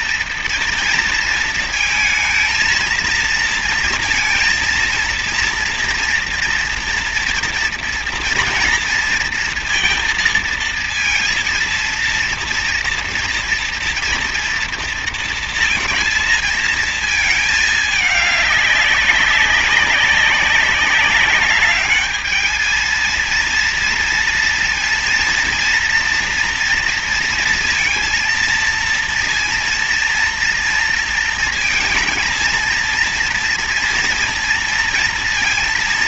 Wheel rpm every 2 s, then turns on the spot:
230, 230, 230, 230, 230, 230, 230, 230, 230, 200, 200, 220, 230, 230, 230, 230, 230, 230.
none